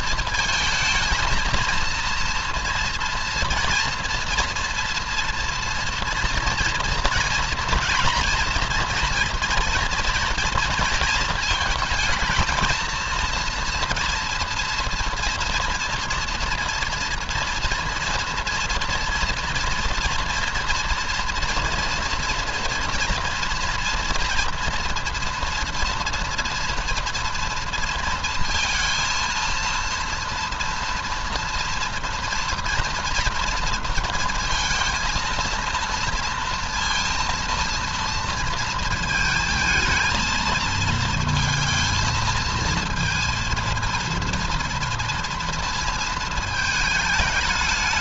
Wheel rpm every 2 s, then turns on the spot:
220, 240, 230, 230, 240, 230, 230, 230, 230, 230, 230, 230, 240, 230, 230, 230, 230, 230, 230, 230, 230, 230, 230, 220.
none